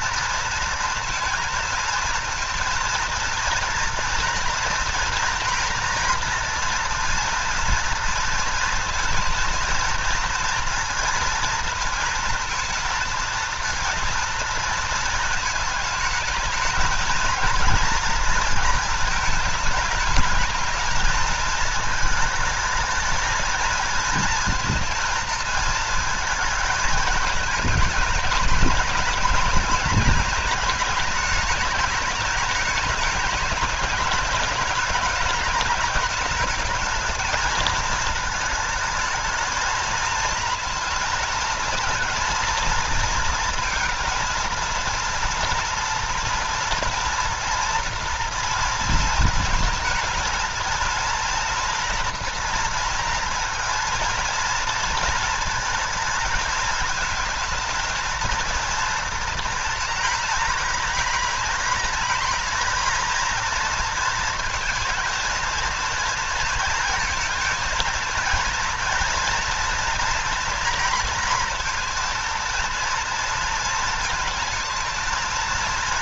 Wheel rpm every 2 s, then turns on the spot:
230, 230, 240, 230, 230, 230, 230, 230, 220, 230, 230, 220, 230, 220, 210, 220, 210, 200, 220, 220, 230, 230, 230, 230, 230, 230, 230, 230, 220, 230, 240, 230, 220, 230, 230, 230, 230, 220.
none